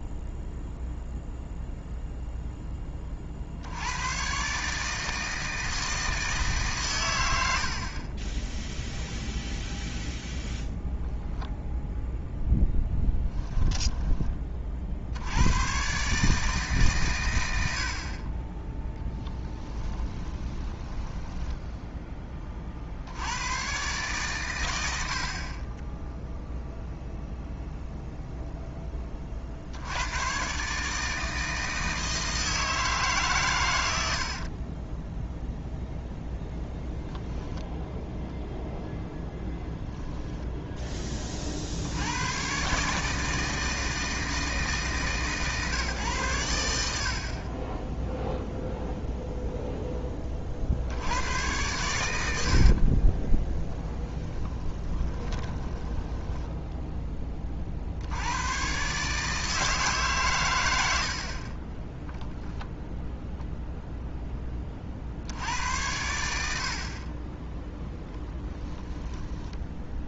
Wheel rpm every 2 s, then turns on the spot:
0, 10, 140, 140, 0, 0, 0, 50, 150, 10, 10, 40, 100, 0, 10, 140, 160, 30, 0, 0, 20, 130, 150, 80, 0, 60, 50, 10, 10, 110, 110, 0, 30, 50, 10.
20-22 34-36 52-56 68-70